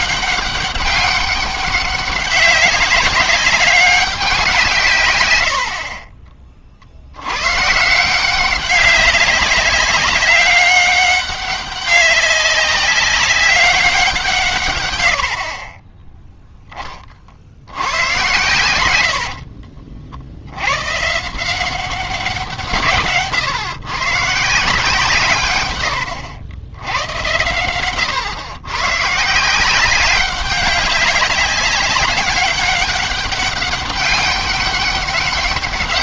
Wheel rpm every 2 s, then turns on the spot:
200, 200, 160, 40, 190, 200, 200, 140, 10, 80, 110, 150, 150, 90, 120, 190, 200, 200.
none